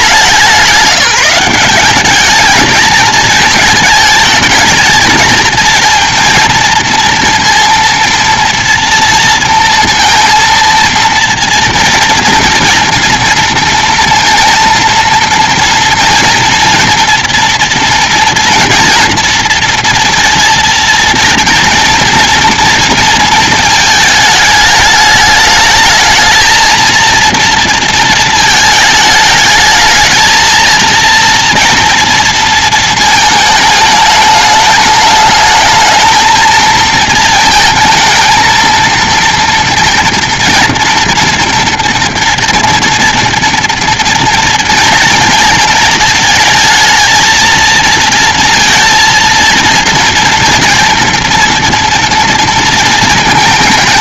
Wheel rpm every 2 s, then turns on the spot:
190, 220, 220, 230, 230, 230, 230, 230, 230, 230, 230, 230, 210, 230, 220, 230, 230, 210, 230, 230, 240, 230, 230, 220, 230, 240, 230.
none